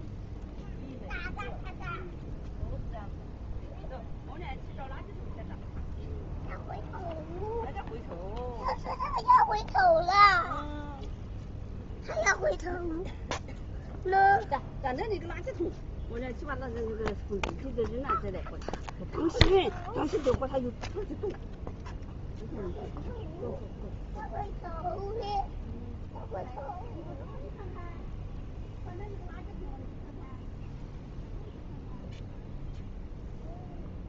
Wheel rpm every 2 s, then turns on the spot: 0, 0, 0, 0, 0, 0, 0, 0, 0, 0, 0, 0, 0, 0, 0, 0, 0.
none